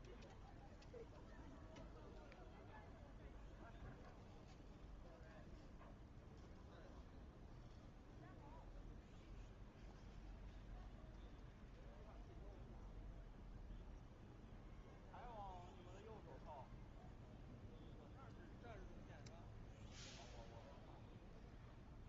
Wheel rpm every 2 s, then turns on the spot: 0, 0, 0, 0, 0, 0, 0, 0, 0, 0, 0.
none